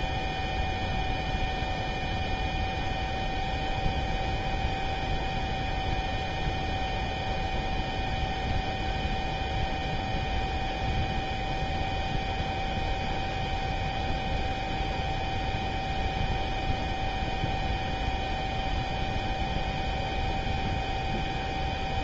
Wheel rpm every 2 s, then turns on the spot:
0, 0, 0, 0, 0, 0, 0, 0, 0, 0, 0.
none